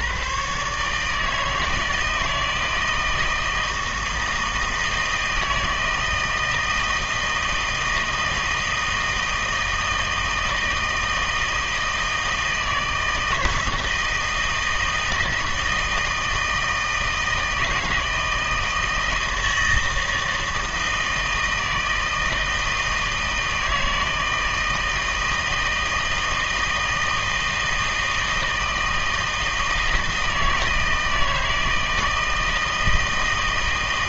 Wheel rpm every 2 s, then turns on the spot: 130, 160, 160, 160, 160, 160, 160, 160, 160, 160, 160, 160, 160, 160, 160, 160, 160.
none